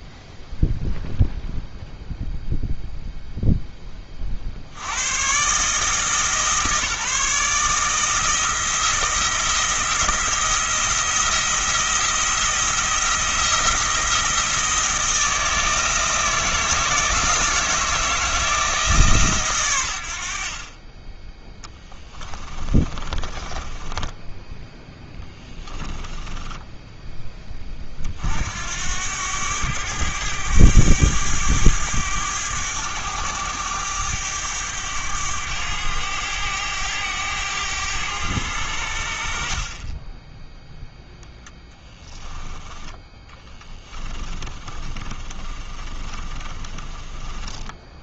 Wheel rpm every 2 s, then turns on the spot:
0, 0, 100, 160, 160, 170, 170, 170, 170, 160, 40, 30, 10, 10, 80, 100, 100, 100, 100, 80, 0, 20, 30, 30.
22-24 26-28 44-48